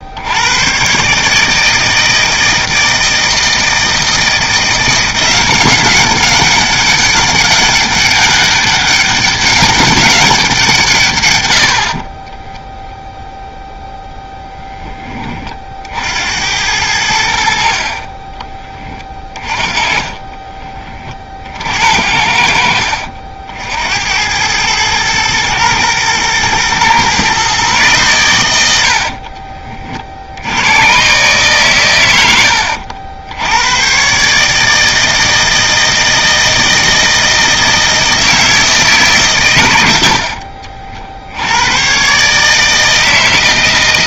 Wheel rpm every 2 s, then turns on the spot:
110, 160, 170, 200, 200, 160, 0, 10, 90, 20, 40, 60, 110, 120, 80, 90, 70, 160, 160, 160, 60, 150.
18-20 28-30